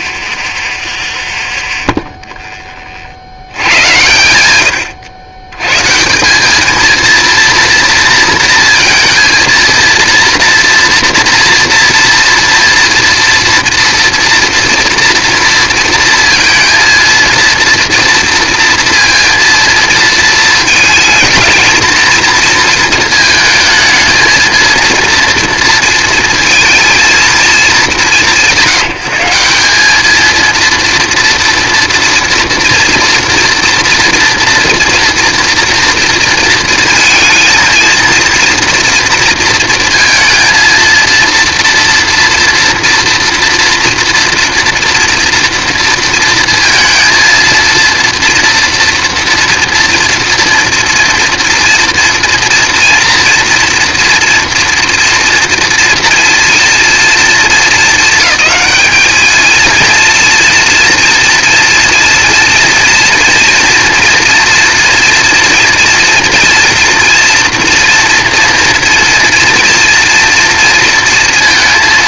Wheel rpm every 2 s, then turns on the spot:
0, 30, 120, 220, 230, 230, 230, 230, 230, 230, 220, 230, 230, 230, 160, 230, 230, 230, 230, 230, 230, 230, 230, 230, 230, 230, 230, 230, 230, 200, 230, 230, 230, 230, 230, 230.
none